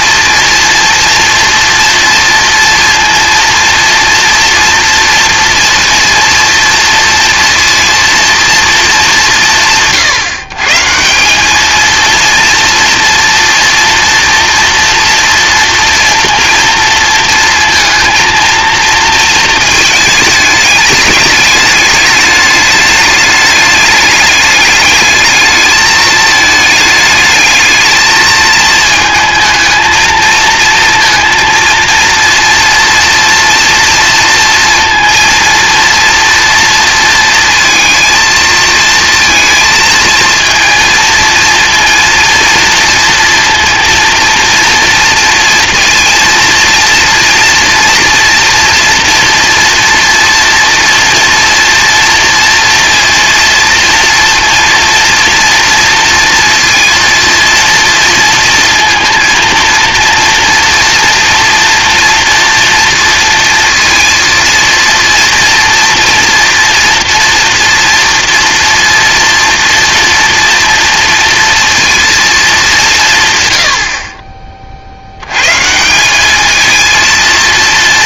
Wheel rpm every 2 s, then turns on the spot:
230, 230, 230, 230, 230, 140, 230, 230, 230, 220, 210, 210, 210, 220, 220, 230, 230, 230, 230, 230, 230, 230, 230, 230, 230, 230, 230, 230, 230, 230, 230, 230, 230, 230, 230, 230, 210, 40, 220.
none